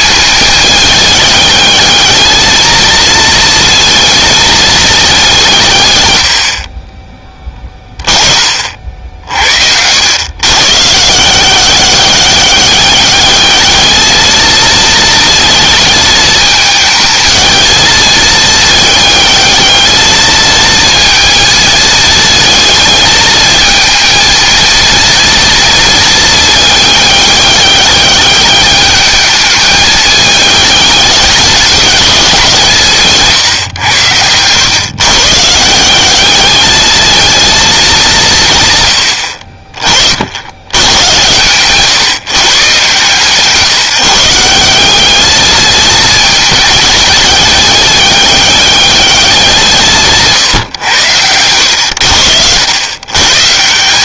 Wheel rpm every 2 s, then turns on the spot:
220, 220, 210, 50, 40, 130, 200, 220, 220, 220, 220, 220, 230, 210, 210, 210, 160, 120, 220, 120, 110, 140, 190, 220, 210, 130, 90.
none